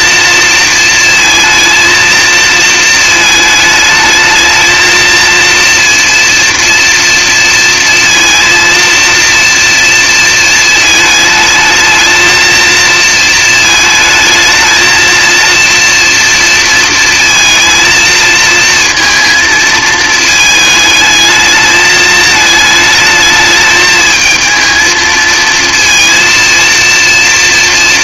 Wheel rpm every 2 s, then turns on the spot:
230, 220, 220, 230, 230, 230, 230, 220, 230, 230, 220, 220, 220, 230.
none